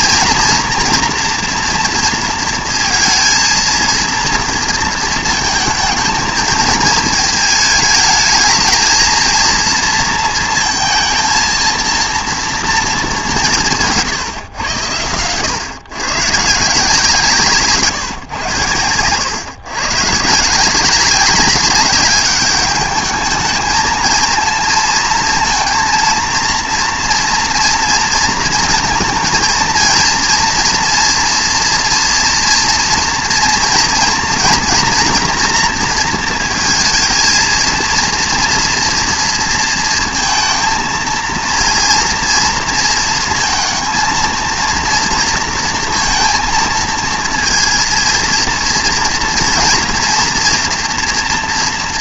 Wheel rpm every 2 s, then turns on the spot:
230, 230, 230, 220, 220, 230, 230, 120, 160, 100, 180, 210, 230, 230, 230, 230, 230, 230, 230, 230, 230, 230, 230, 230, 230, 240.
none